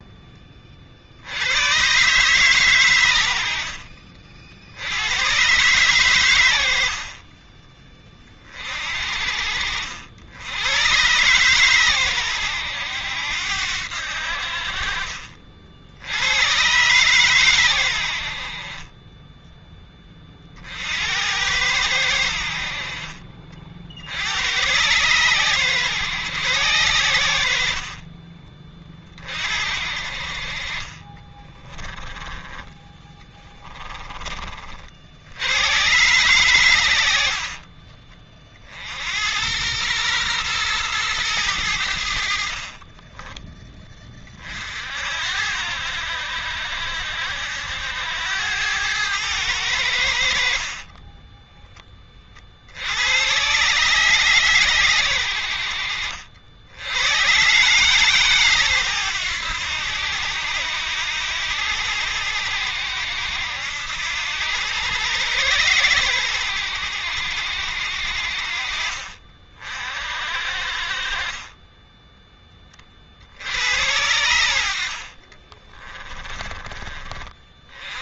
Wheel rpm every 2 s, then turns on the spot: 30, 130, 60, 90, 40, 100, 100, 60, 100, 50, 50, 60, 100, 110, 30, 40, 20, 40, 100, 50, 120, 50, 50, 70, 90, 60, 50, 120, 70, 130, 90, 90, 90, 90, 50, 50, 20, 80, 30.
42-44 50-52 74-76